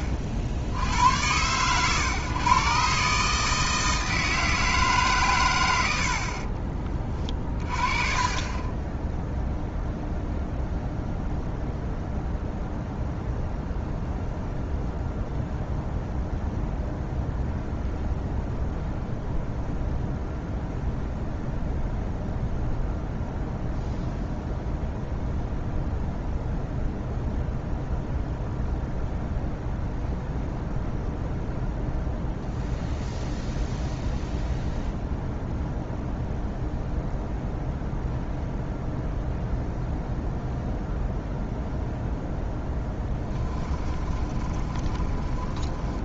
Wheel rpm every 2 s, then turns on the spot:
80, 140, 150, 40, 10, 0, 0, 0, 0, 0, 0, 0, 0, 0, 0, 0, 0, 0, 0, 0, 0, 10, 20.
44-46